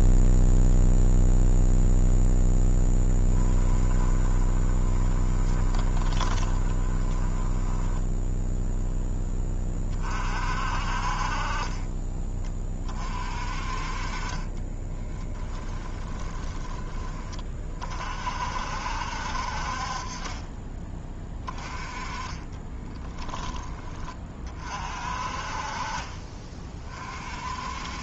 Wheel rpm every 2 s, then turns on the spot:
0, 10, 20, 20, 0, 50, 30, 20, 20, 60, 20, 20, 40, 30.
4-8 14-16 22-24